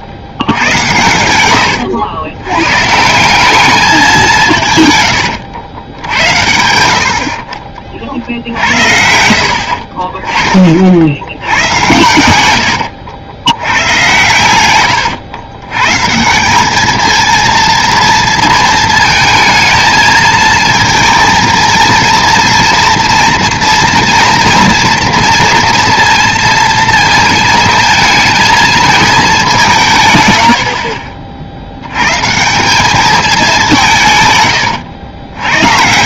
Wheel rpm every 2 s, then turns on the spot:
100, 120, 130, 80, 70, 40, 90, 110, 190, 220, 230, 230, 230, 230, 220, 70, 180, 100.
8-10 30-32